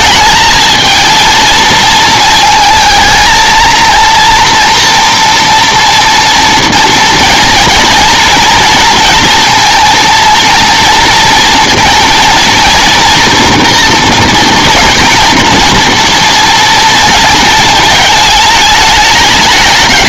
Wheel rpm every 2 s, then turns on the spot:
220, 220, 230, 230, 230, 230, 230, 230, 230, 220.
none